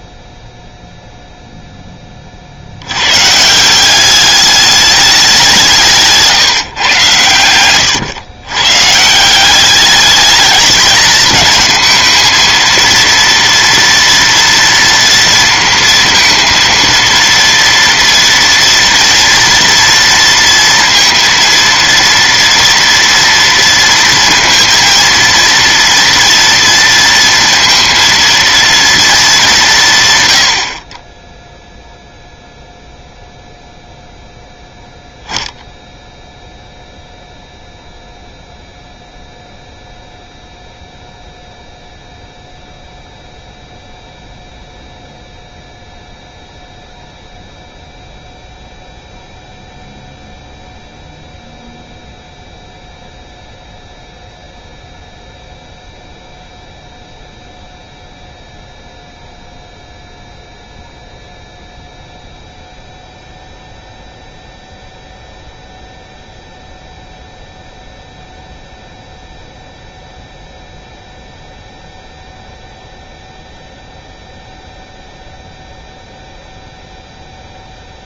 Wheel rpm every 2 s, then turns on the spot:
0, 60, 210, 140, 120, 210, 220, 230, 230, 240, 230, 230, 230, 230, 230, 90, 0, 0, 0, 0, 0, 0, 0, 0, 0, 0, 0, 0, 0, 0, 0, 0, 0, 0, 0, 0, 0, 0, 0.
none